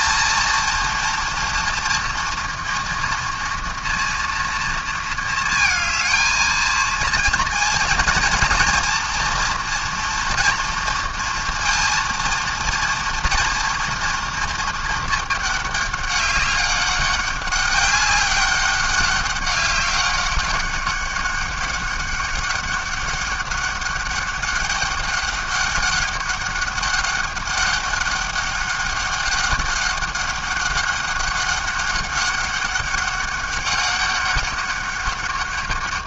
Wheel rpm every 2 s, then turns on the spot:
230, 240, 230, 230, 230, 240, 230, 230, 200, 190, 190, 200, 200, 200, 200, 190, 200, 200.
none